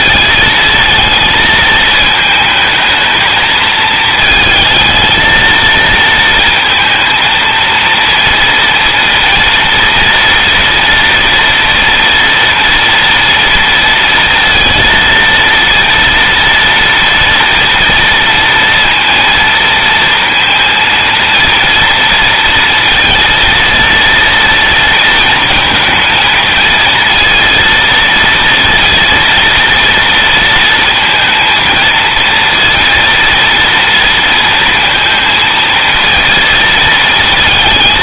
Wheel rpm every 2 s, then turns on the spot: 220, 220, 220, 230, 230, 230, 230, 230, 230, 230, 230, 230, 230, 230, 230, 230, 230, 230, 230.
none